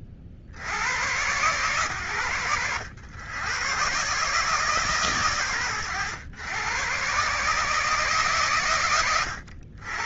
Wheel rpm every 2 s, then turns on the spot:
40, 100, 140, 110, 110.
none